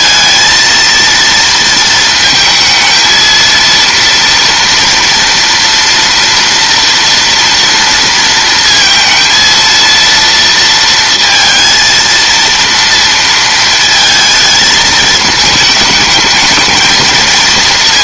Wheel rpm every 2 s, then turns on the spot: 230, 230, 230, 230, 220, 230, 230, 220, 220.
none